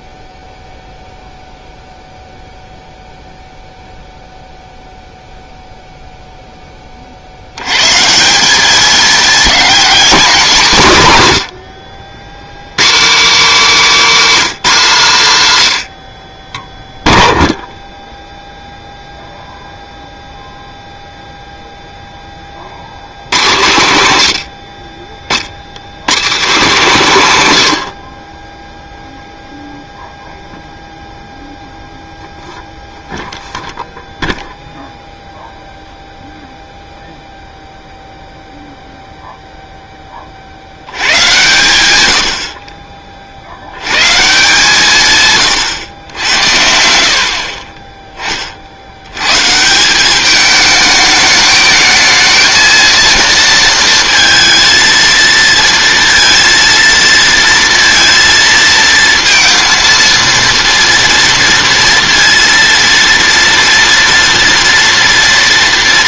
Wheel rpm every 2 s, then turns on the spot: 0, 0, 0, 10, 200, 170, 140, 210, 10, 0, 0, 50, 60, 160, 0, 0, 0, 0, 0, 0, 80, 40, 150, 70, 60, 210, 220, 230, 230, 230, 230, 230, 230.
none